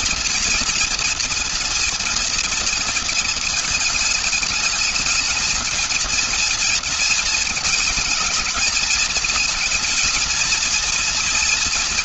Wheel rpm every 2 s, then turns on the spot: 230, 230, 220, 230, 220, 230.
none